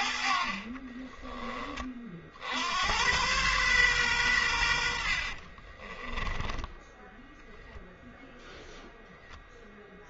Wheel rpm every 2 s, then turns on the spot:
30, 90, 70, 10, 0.
0-2 4-8